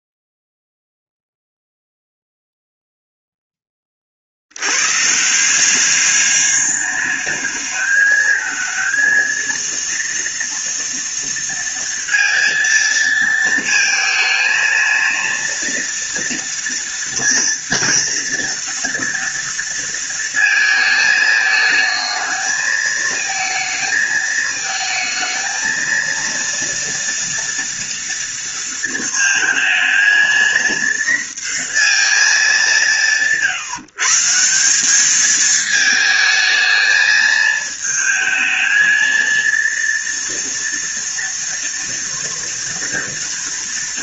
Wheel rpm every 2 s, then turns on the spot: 0, 0, 70, 200, 220, 230, 230, 230, 230, 230, 230, 220, 220, 230, 230, 230, 180, 170, 220, 220, 230, 230.
none